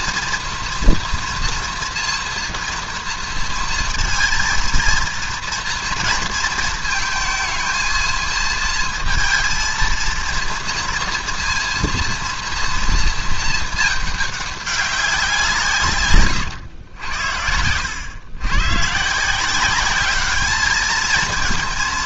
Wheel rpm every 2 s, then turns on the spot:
230, 230, 230, 230, 230, 230, 230, 210, 140, 100, 200.
none